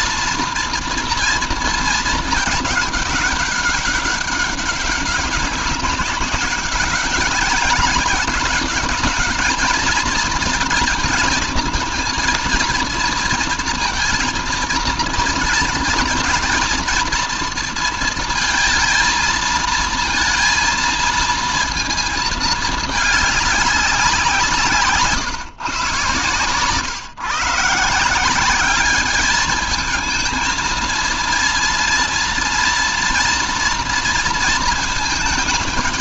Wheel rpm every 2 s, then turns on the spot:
240, 210, 200, 190, 200, 230, 230, 230, 230, 220, 230, 220, 170, 130, 200, 230, 240, 230.
none